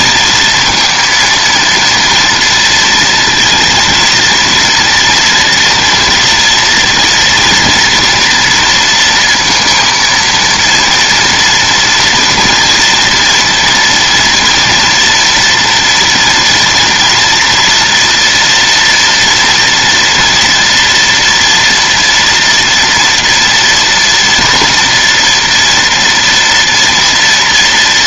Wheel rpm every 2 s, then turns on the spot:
230, 230, 230, 230, 230, 230, 230, 230, 240, 230, 230, 230, 230, 230.
none